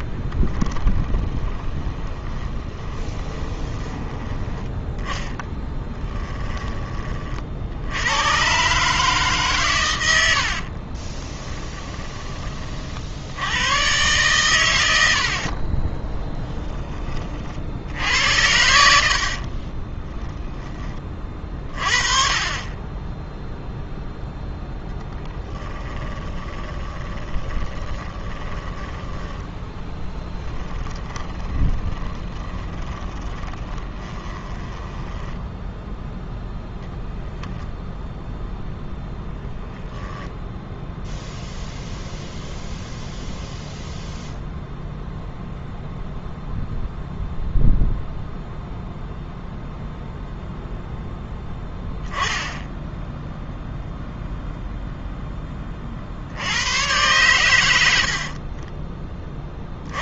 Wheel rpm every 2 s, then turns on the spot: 10, 20, 10, 20, 140, 40, 50, 100, 20, 70, 20, 20, 10, 20, 10, 20, 20, 10, 0, 0, 0, 0, 0, 0, 0, 0, 0, 0, 100, 20.
0-4 10-12 18-20 26-28 30-36